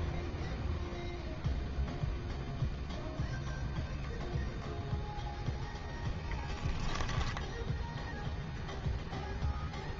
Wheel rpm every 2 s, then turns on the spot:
0, 0, 0, 10, 0.
6-8